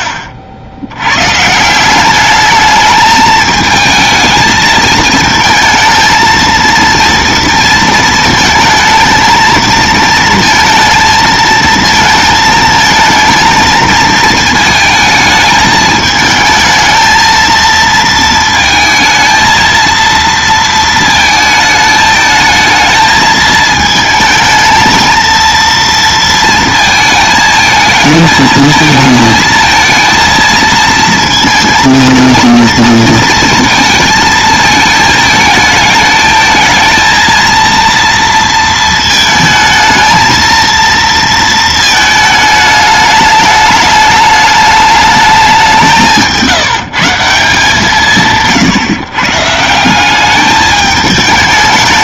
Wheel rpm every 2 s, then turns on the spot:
120, 220, 220, 230, 230, 230, 220, 220, 220, 220, 220, 220, 230, 220, 220, 230, 230, 220, 220, 220, 230, 210, 210, 170, 140, 210.
none